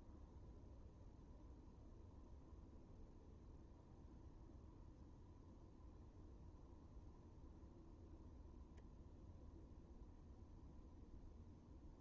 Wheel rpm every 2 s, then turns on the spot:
0, 0, 0, 0, 0, 0.
none